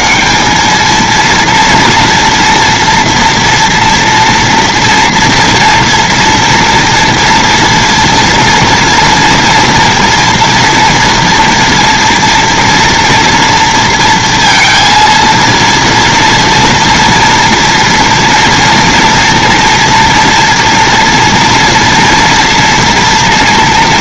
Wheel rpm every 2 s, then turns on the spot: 110, 230, 230, 230, 240, 230, 230, 230, 230, 230, 230, 230.
none